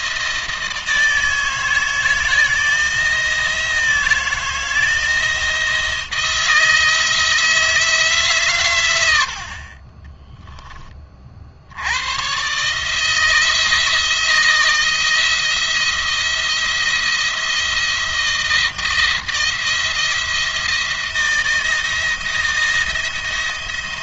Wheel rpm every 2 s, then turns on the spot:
160, 160, 160, 160, 120, 30, 140, 170, 170, 170, 160, 170.
none